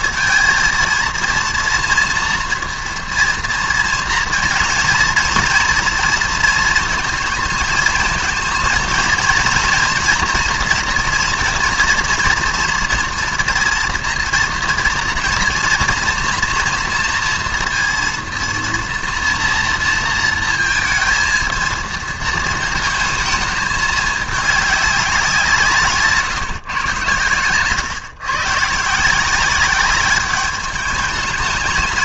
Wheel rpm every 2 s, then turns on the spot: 230, 230, 230, 230, 230, 240, 230, 230, 240, 230, 220, 220, 210, 140, 140, 200.
none